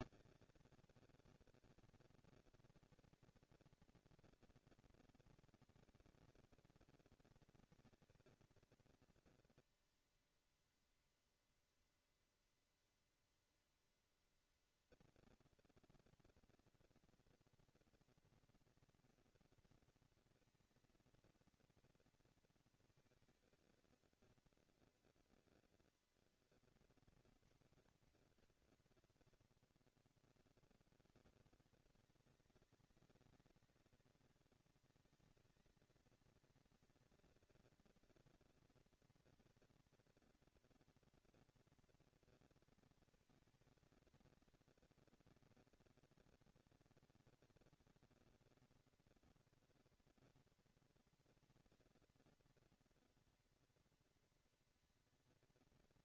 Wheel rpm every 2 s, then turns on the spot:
200, 220, 230, 220, 230, 230, 230, 230, 230, 230, 230, 220, 230, 240, 190, 70, 190, 210, 230, 230, 230, 230, 230, 230, 230, 230, 230, 240.
none